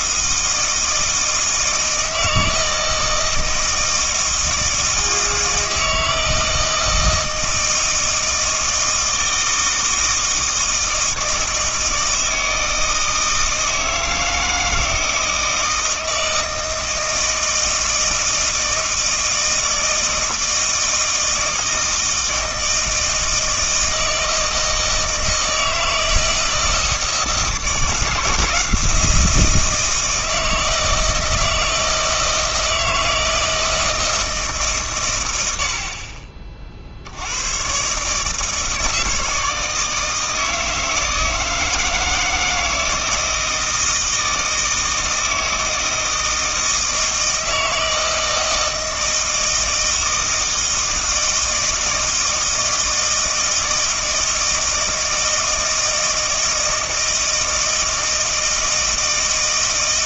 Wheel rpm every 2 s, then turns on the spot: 160, 160, 160, 160, 160, 160, 160, 160, 160, 160, 160, 160, 160, 160, 170, 160, 160, 140, 60, 160, 160, 160, 160, 160, 160, 160, 160, 160, 160, 160.
none